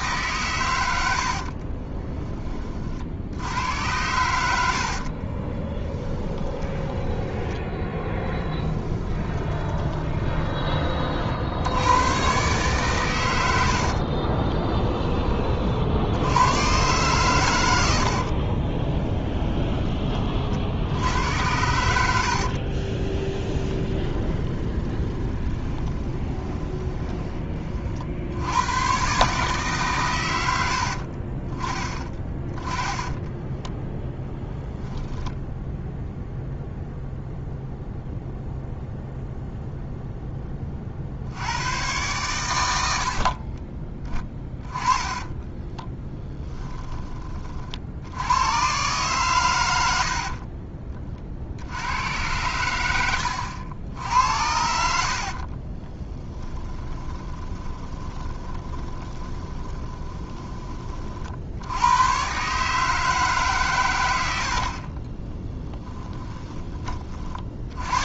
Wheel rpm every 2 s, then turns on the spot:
80, 50, 50, 10, 20, 40, 120, 20, 120, 20, 80, 30, 20, 20, 120, 60, 10, 0, 0, 0, 50, 80, 20, 20, 130, 40, 100, 60, 20, 20, 30, 150, 40, 30.
0-2 4-10 18-20 22-28 30-32 44-46 54-60